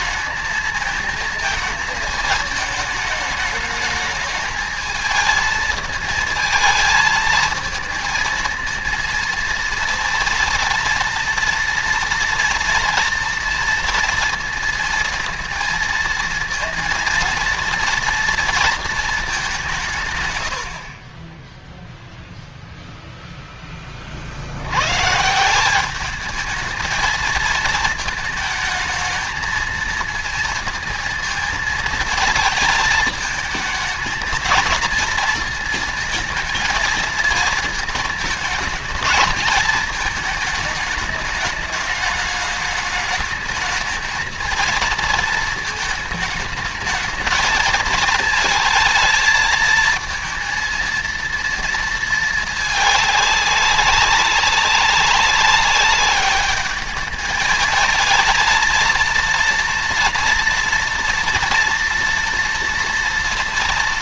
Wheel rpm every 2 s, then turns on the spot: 230, 220, 220, 220, 230, 230, 230, 230, 230, 220, 30, 0, 120, 220, 220, 220, 220, 230, 230, 220, 210, 220, 230, 220, 220, 230, 210, 200, 210, 230, 230, 230.
none